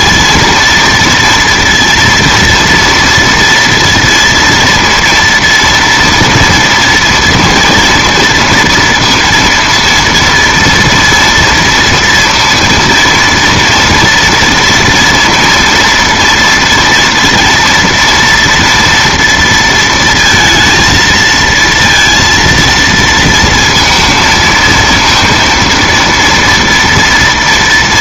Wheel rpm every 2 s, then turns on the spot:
230, 230, 230, 230, 230, 230, 230, 230, 240, 230, 230, 230, 230, 230.
none